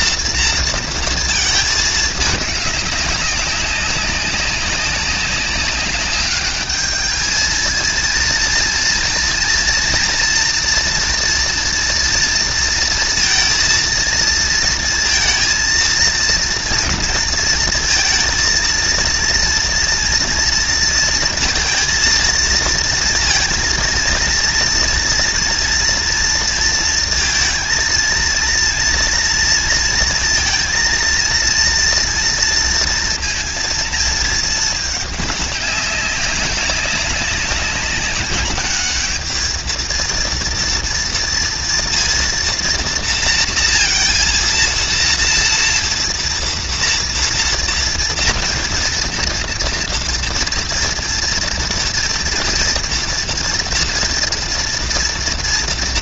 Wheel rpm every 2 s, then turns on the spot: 220, 200, 200, 220, 230, 230, 230, 230, 230, 230, 230, 230, 230, 230, 230, 230, 230, 210, 190, 220, 230, 230, 230, 230, 230, 230, 230, 230.
none